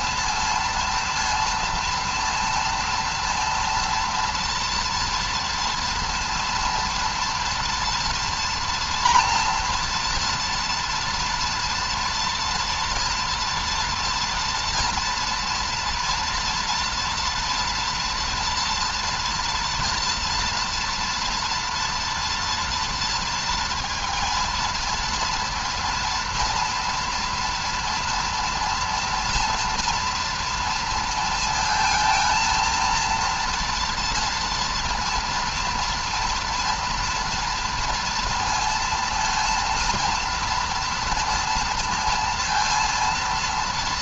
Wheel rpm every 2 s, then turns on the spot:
230, 230, 230, 230, 230, 230, 230, 230, 230, 230, 230, 230, 230, 240, 240, 240, 230, 230, 230, 230, 230, 230.
none